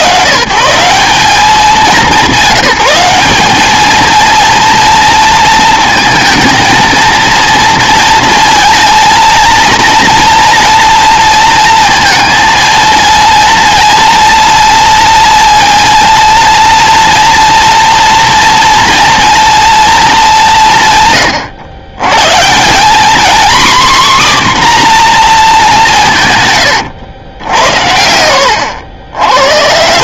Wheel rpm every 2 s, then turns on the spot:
150, 180, 230, 220, 230, 230, 230, 230, 230, 230, 150, 170, 260, 110, 90.
none